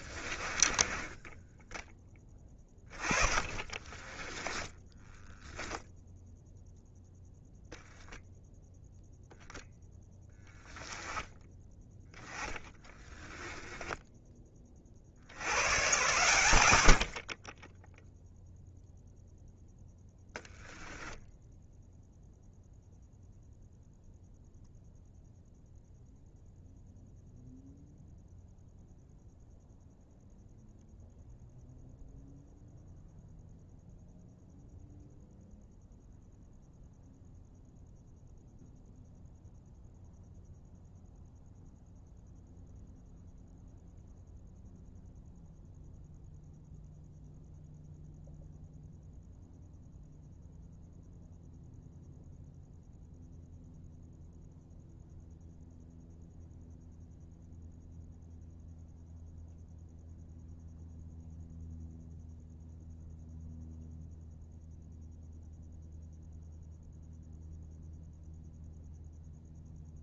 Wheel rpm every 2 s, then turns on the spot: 20, 20, 10, 0, 0, 10, 10, 30, 90, 0, 10, 0, 0, 0, 0, 0, 0, 0, 0, 0, 0, 0, 0, 0, 0, 0, 0, 0, 0, 0, 0, 0, 0, 0, 0.
0-6 12-14